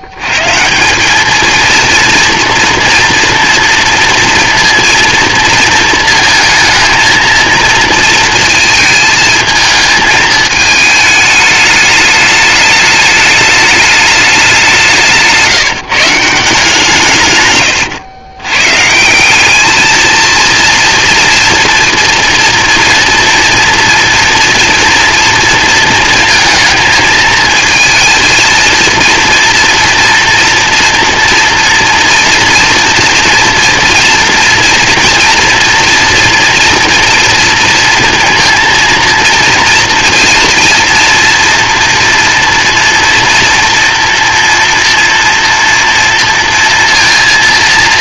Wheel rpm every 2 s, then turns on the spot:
110, 230, 230, 220, 220, 220, 210, 200, 170, 120, 230, 240, 230, 230, 230, 240, 230, 240, 240, 230, 230, 230, 230, 230.
none